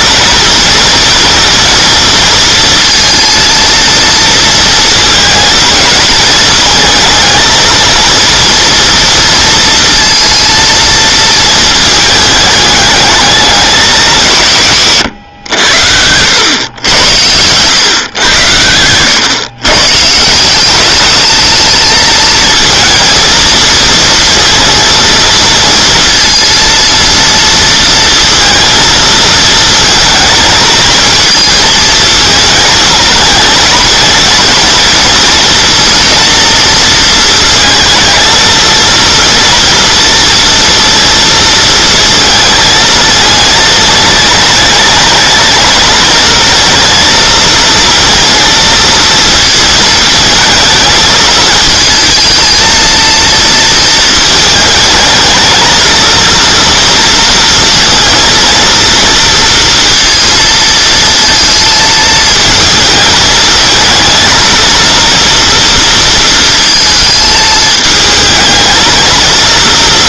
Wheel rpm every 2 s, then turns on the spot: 230, 230, 230, 220, 230, 230, 220, 130, 100, 100, 180, 230, 230, 230, 230, 230, 220, 230, 240, 230, 230, 220, 210, 220, 230, 220, 230, 220, 230, 230, 230, 220, 230, 230, 220.
18-20